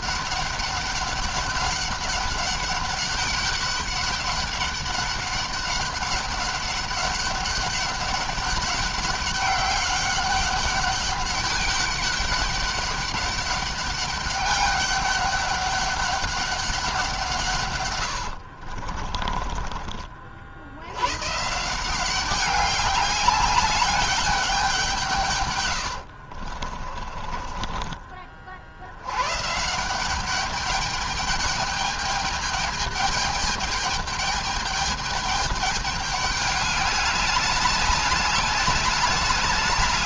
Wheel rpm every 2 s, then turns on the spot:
200, 200, 200, 200, 200, 200, 200, 200, 190, 60, 60, 200, 180, 50, 60, 210, 210, 220, 210, 210.
18-20 26-28